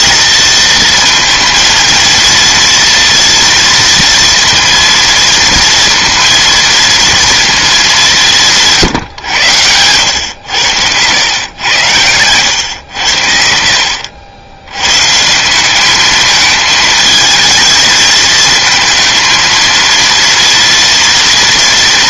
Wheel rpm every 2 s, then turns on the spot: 230, 230, 230, 230, 130, 100, 80, 140, 220, 230, 230.
none